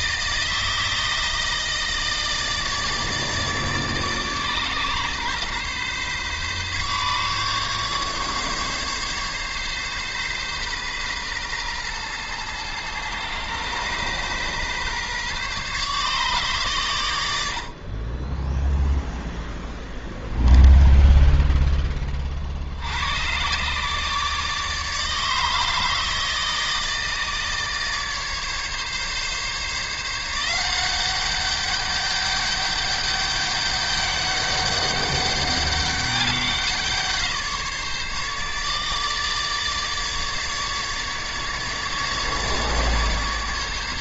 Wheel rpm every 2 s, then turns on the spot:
160, 150, 140, 140, 140, 130, 120, 130, 110, 0, 10, 90, 150, 160, 140, 190, 200, 200, 180, 150, 150, 150.
20-22